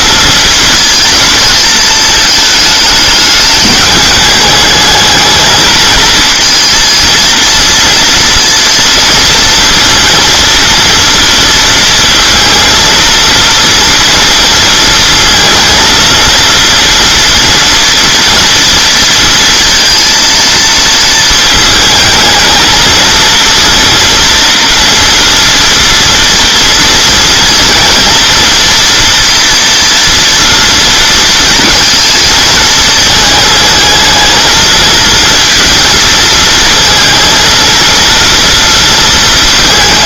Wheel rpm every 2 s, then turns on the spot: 220, 210, 220, 230, 230, 230, 230, 230, 230, 230, 220, 220, 230, 230, 240, 230, 220, 220, 230, 230.
none